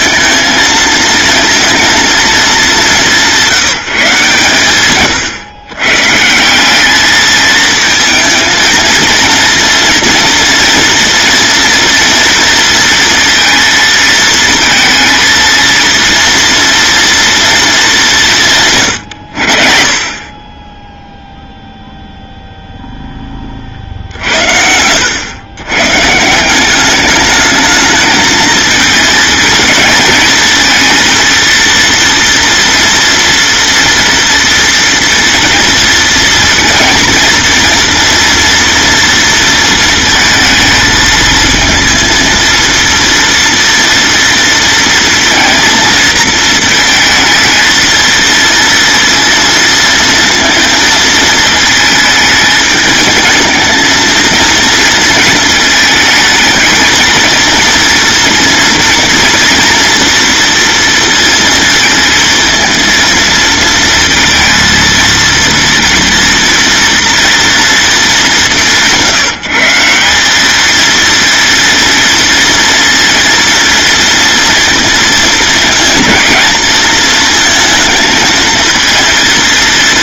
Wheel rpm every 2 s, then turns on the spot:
230, 190, 130, 210, 230, 230, 230, 230, 230, 130, 10, 10, 80, 200, 220, 230, 230, 230, 230, 230, 220, 230, 230, 220, 230, 230, 220, 230, 220, 240, 230, 230, 230, 230, 180, 230, 230, 230, 220, 220.
none